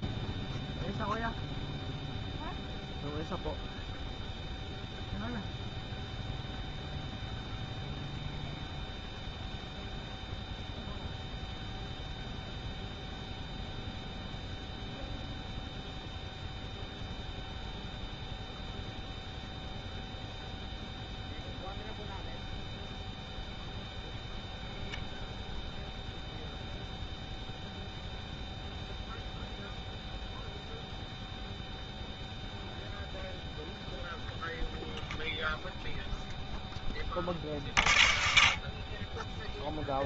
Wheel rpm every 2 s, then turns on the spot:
0, 0, 0, 0, 0, 0, 0, 0, 0, 0, 0, 0, 0, 0, 0, 0, 0, 20, 40, 0.
none